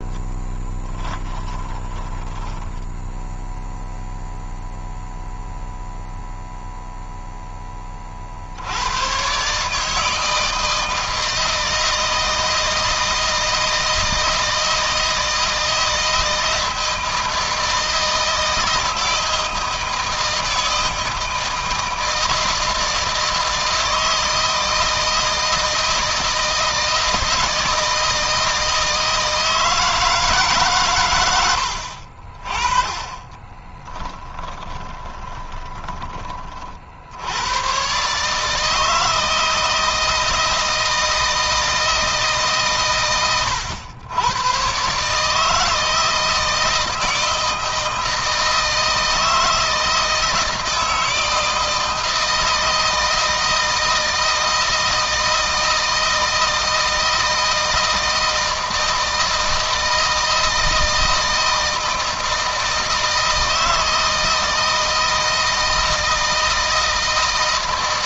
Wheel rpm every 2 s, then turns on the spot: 10, 10, 0, 0, 80, 160, 160, 160, 160, 160, 160, 160, 160, 160, 160, 140, 30, 20, 50, 160, 160, 140, 130, 160, 160, 160, 160, 160, 160, 160, 160, 160, 160, 160.
0-2 34-36